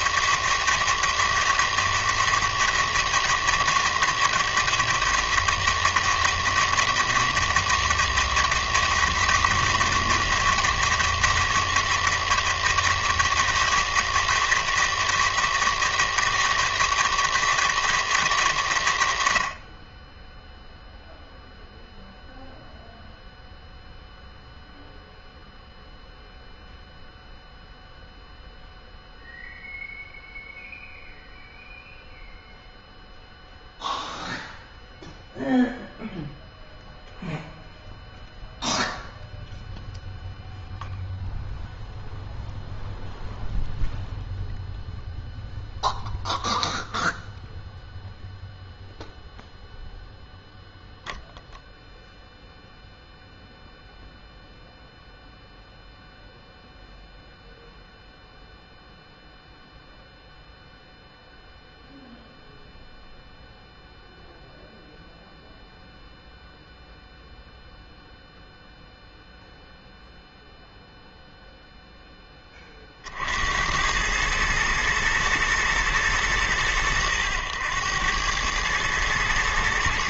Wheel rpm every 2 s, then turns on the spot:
160, 160, 160, 160, 160, 160, 160, 160, 160, 140, 0, 0, 0, 0, 0, 0, 0, 0, 0, 0, 0, 0, 0, 0, 0, 0, 0, 0, 0, 0, 0, 0, 0, 0, 0, 0, 20, 110, 110, 100.
none